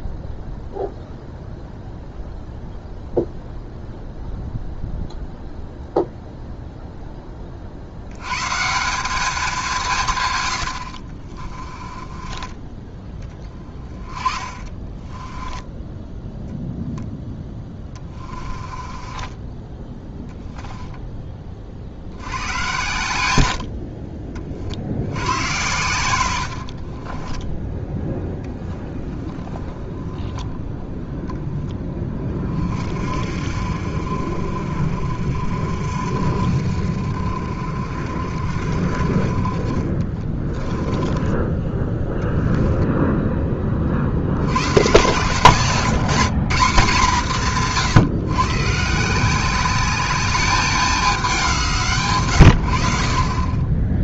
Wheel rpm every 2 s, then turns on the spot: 0, 0, 0, 0, 170, 70, 20, 20, 0, 20, 10, 100, 70, 50, 10, 0, 40, 50, 60, 60, 20, 10, 120, 190, 150, 200, 70.
10-12 14-16 18-22 26-28 40-44